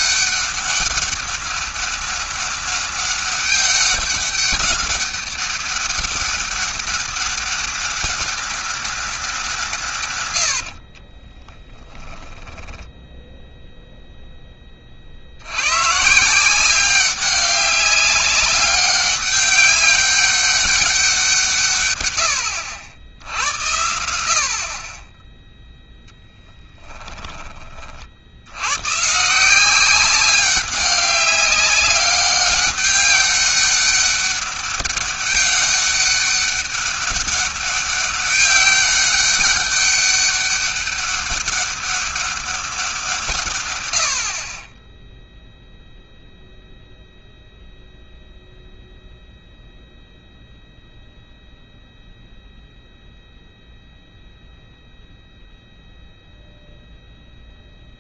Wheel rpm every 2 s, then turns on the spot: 200, 200, 200, 200, 200, 90, 10, 20, 180, 200, 200, 90, 40, 20, 110, 200, 200, 200, 200, 200, 200, 180, 20, 0, 0, 0, 0, 0, 0.
10-12 26-28